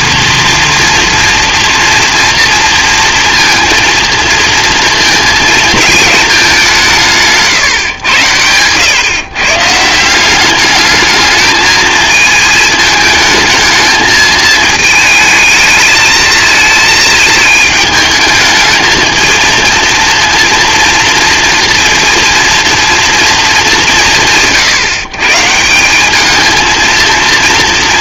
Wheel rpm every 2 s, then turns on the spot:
230, 230, 230, 160, 130, 220, 220, 220, 220, 220, 230, 230, 130, 230.
none